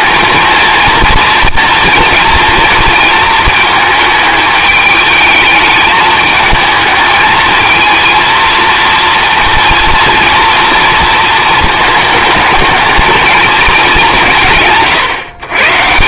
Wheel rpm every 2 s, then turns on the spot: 230, 230, 210, 220, 230, 230, 220, 150.
none